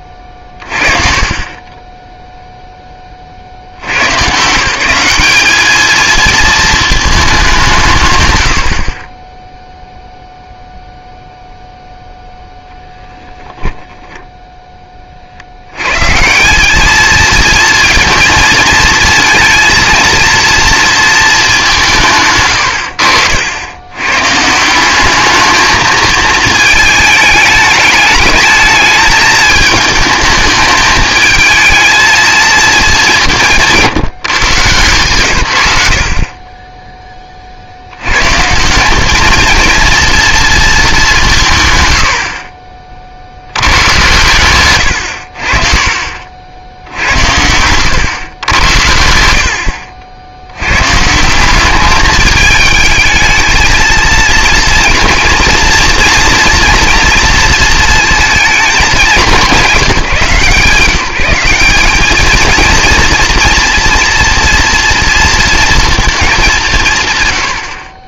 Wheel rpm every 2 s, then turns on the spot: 30, 0, 170, 220, 60, 0, 0, 10, 210, 230, 230, 90, 170, 220, 220, 220, 220, 140, 20, 190, 220, 50, 100, 80, 90, 120, 220, 240, 240, 210, 170, 230, 230, 170.
none